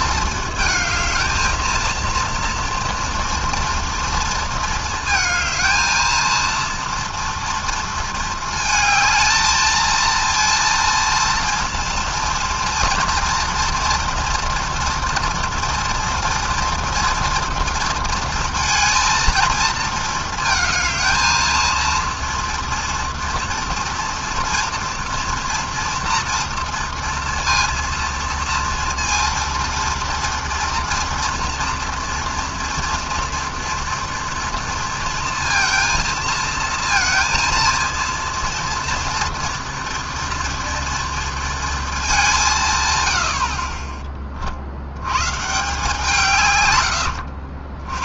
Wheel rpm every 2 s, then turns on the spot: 220, 240, 230, 230, 220, 230, 230, 230, 240, 230, 220, 240, 230, 230, 230, 230, 230, 230, 230, 230, 230, 70, 140, 90.
none